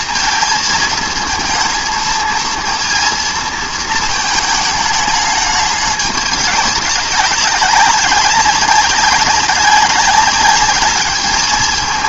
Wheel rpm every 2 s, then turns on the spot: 220, 230, 220, 200, 190, 200.
none